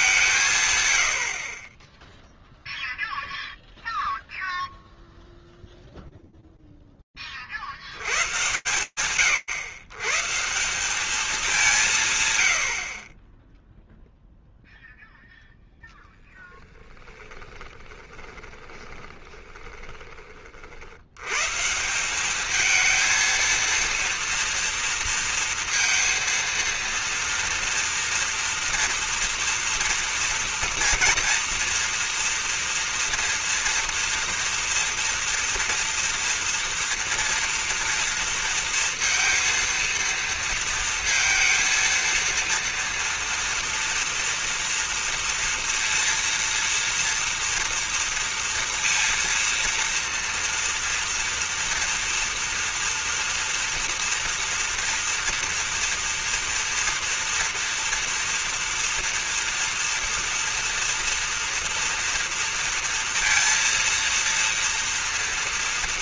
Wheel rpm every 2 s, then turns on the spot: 90, 0, 0, 100, 110, 170, 0, 0, 10, 20, 130, 230, 230, 230, 230, 230, 230, 230, 230, 230, 230, 230, 230, 230, 230, 230, 230, 230, 230, 230, 240, 230, 230.
16-20